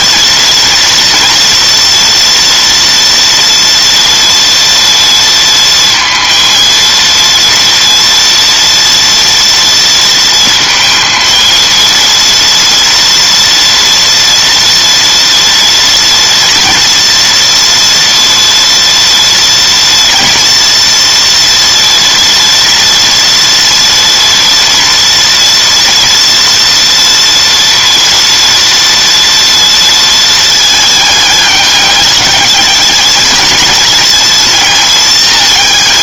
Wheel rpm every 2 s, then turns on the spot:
230, 230, 230, 230, 230, 220, 230, 230, 230, 240, 240, 230, 230, 240, 230, 220, 220, 220.
none